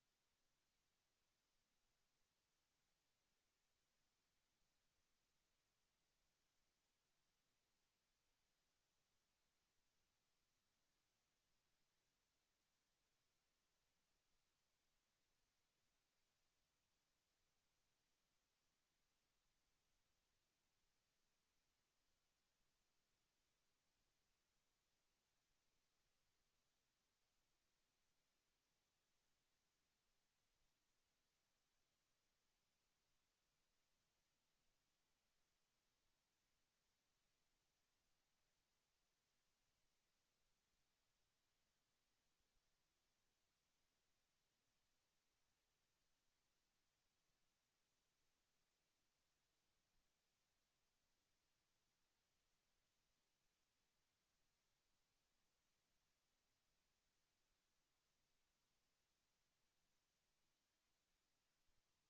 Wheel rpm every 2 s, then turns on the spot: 0, 0, 0, 0, 0, 0, 0, 0, 0, 0, 0, 0, 0, 0, 0, 0, 0, 0, 0, 0, 0, 0, 0, 0, 0, 0, 0, 0, 0, 0, 0.
none